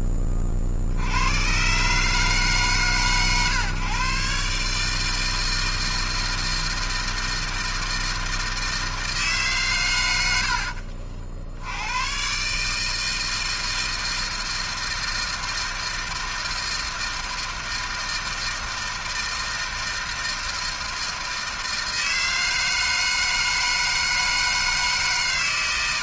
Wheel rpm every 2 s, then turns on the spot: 70, 140, 140, 160, 160, 60, 140, 160, 160, 160, 160, 160, 150.
none